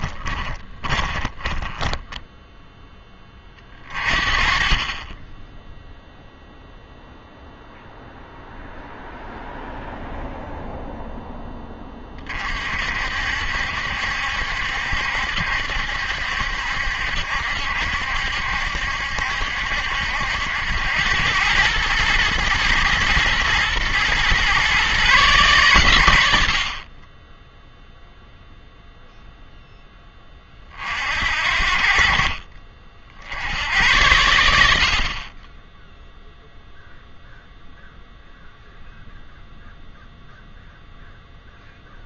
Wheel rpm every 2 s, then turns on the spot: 20, 0, 30, 0, 0, 0, 50, 70, 70, 70, 90, 110, 130, 60, 0, 40, 40, 70, 0, 0, 0.
0-2